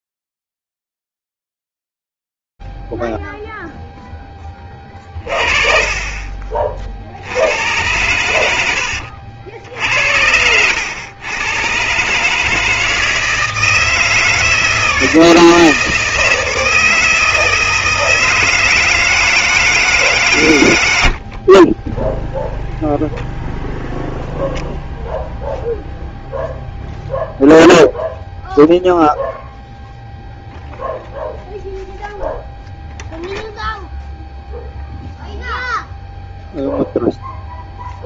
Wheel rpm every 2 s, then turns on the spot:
0, 0, 20, 40, 100, 90, 160, 160, 160, 160, 120, 0, 0, 0, 0, 0, 0, 0, 0.
none